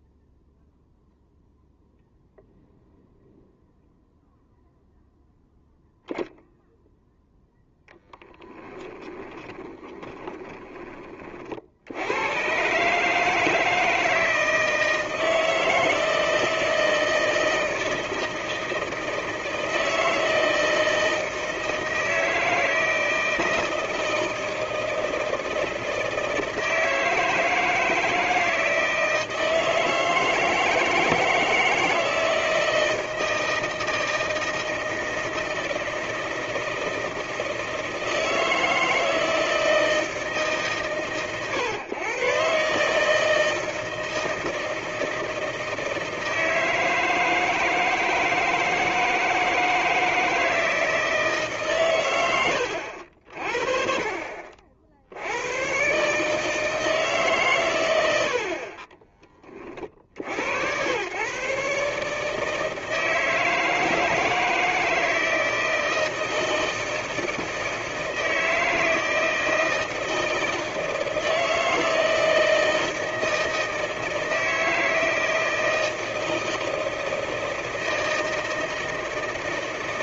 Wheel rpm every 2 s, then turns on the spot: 0, 0, 0, 0, 10, 20, 140, 160, 160, 160, 160, 160, 160, 160, 160, 160, 160, 160, 160, 160, 140, 140, 160, 160, 160, 160, 80, 60, 160, 40, 100, 160, 160, 160, 160, 160, 160, 160, 160, 160.
8-10